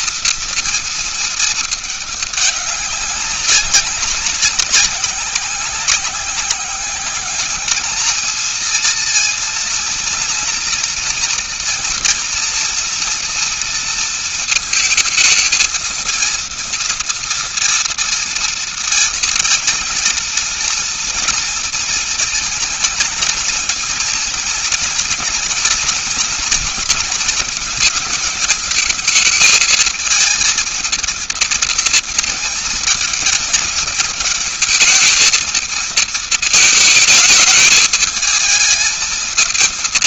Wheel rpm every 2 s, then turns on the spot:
230, 200, 190, 190, 230, 230, 230, 220, 230, 230, 230, 230, 230, 240, 220, 220, 230, 220, 220, 220.
none